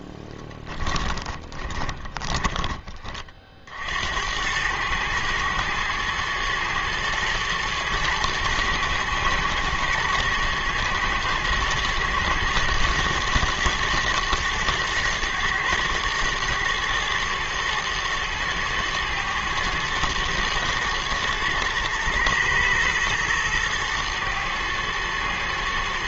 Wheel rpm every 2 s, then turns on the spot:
20, 30, 110, 110, 110, 120, 110, 110, 110, 110, 110, 110, 110.
0-2